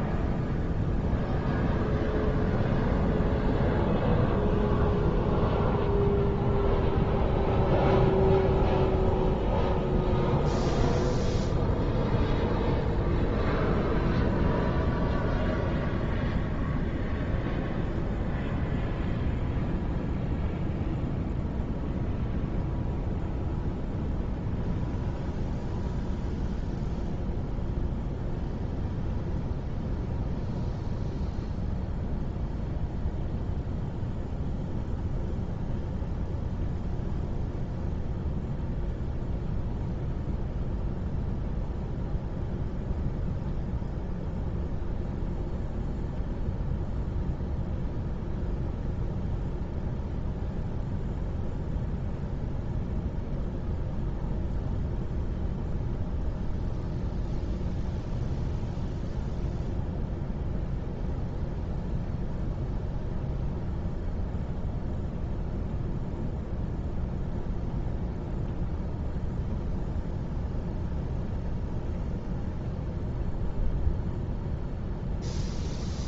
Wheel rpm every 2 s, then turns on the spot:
0, 0, 0, 0, 0, 0, 0, 0, 0, 0, 0, 0, 0, 0, 0, 0, 0, 0, 0, 0, 0, 0, 0, 0, 0, 0, 0, 0, 0, 0, 0, 0, 0, 0, 0, 0, 0, 0.
none